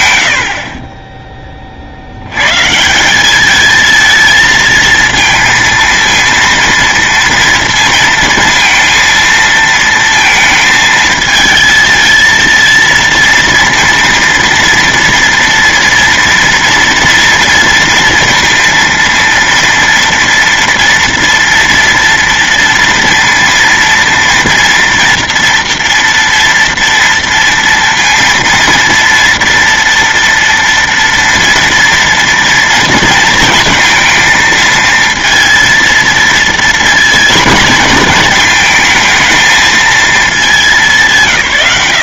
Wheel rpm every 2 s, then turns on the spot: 50, 180, 230, 230, 230, 220, 230, 230, 230, 230, 230, 230, 230, 230, 230, 230, 230, 230, 230, 220, 190.
none